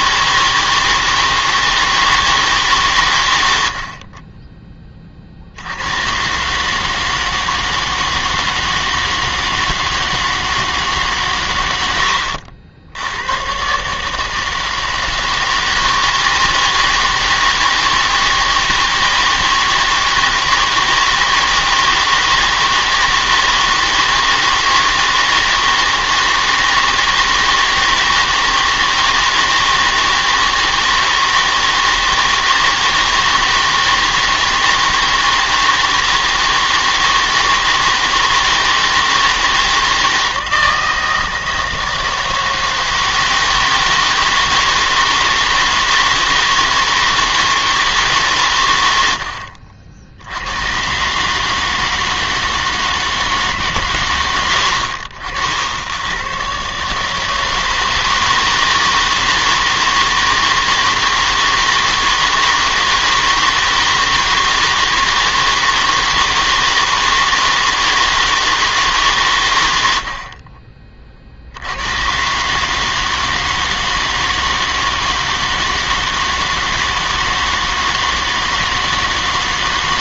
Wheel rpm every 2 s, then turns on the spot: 160, 150, 20, 140, 160, 160, 80, 160, 160, 160, 160, 160, 160, 160, 160, 160, 160, 160, 160, 160, 160, 160, 160, 160, 110, 110, 160, 80, 130, 160, 160, 160, 160, 160, 160, 40, 150, 160, 160, 160.
none